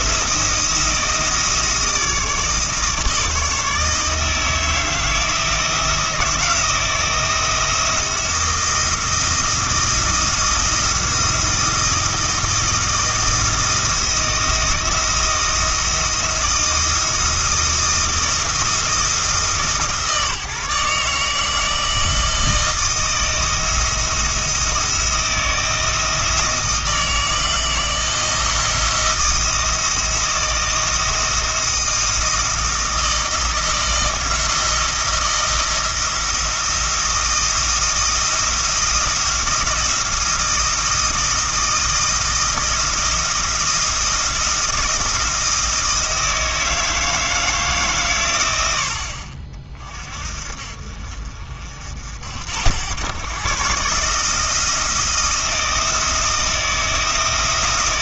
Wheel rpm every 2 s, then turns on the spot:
170, 160, 160, 170, 170, 170, 170, 170, 160, 160, 150, 160, 160, 160, 160, 160, 160, 170, 170, 170, 160, 170, 170, 160, 80, 50, 100, 170, 170.
none